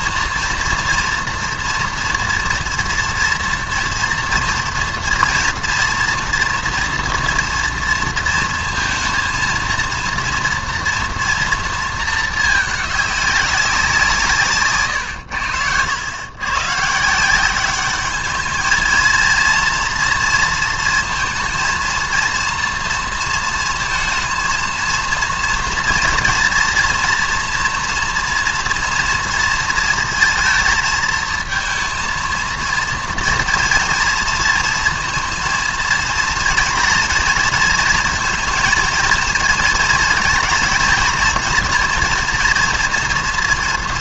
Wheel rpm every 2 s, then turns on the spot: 230, 230, 230, 230, 230, 230, 210, 140, 130, 220, 230, 230, 220, 230, 230, 230, 230, 230, 230, 230, 230, 240.
none